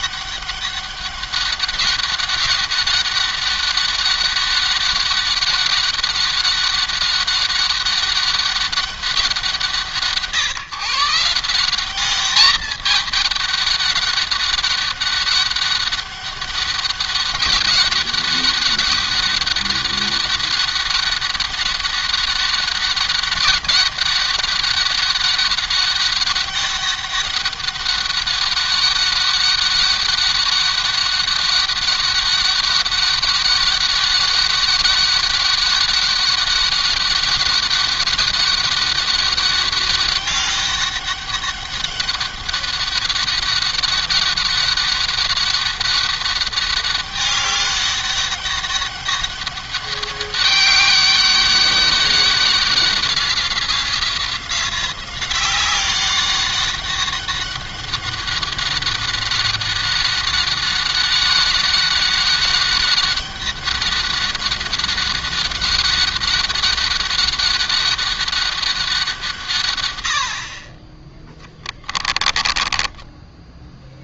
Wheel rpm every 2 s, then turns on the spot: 200, 200, 200, 200, 200, 140, 210, 200, 200, 200, 200, 200, 200, 200, 200, 200, 200, 200, 200, 200, 200, 200, 200, 200, 200, 200, 190, 180, 190, 190, 190, 200, 200, 200, 190, 40, 20.
72-74